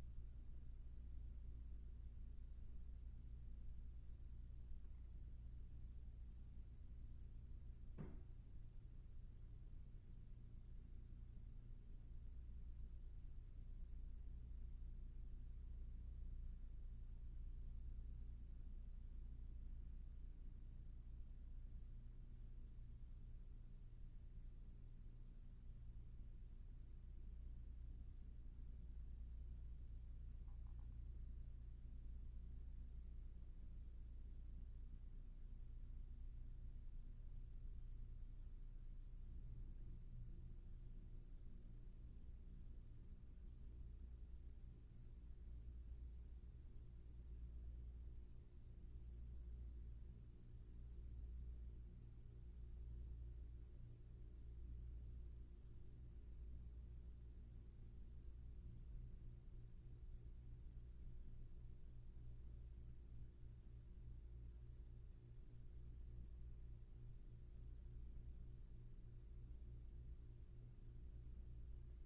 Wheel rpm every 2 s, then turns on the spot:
0, 0, 0, 0, 0, 0, 0, 0, 0, 0, 0, 0, 0, 0, 0, 0, 0, 0, 0, 0, 0, 0, 0, 0, 0, 0, 0, 0, 0, 0, 0, 0, 0, 0, 0, 0.
none